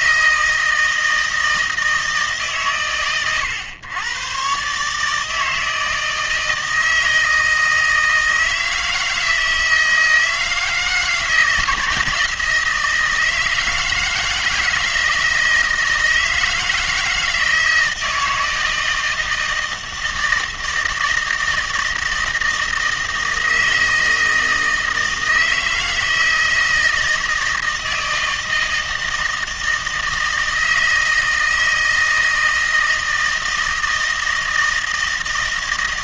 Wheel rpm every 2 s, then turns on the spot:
160, 140, 140, 160, 160, 160, 160, 160, 160, 160, 160, 160, 160, 160, 160, 160, 160, 160.
none